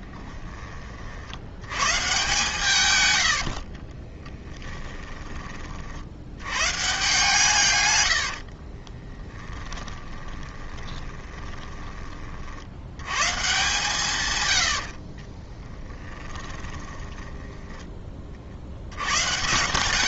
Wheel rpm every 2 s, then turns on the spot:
30, 130, 10, 120, 30, 20, 80, 80, 10, 70.
4-6 8-12 16-18